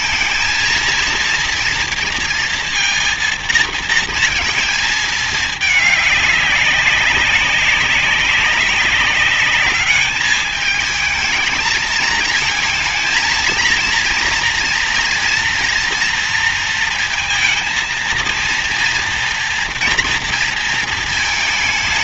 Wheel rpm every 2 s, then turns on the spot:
230, 230, 220, 200, 190, 210, 220, 230, 230, 230, 230.
none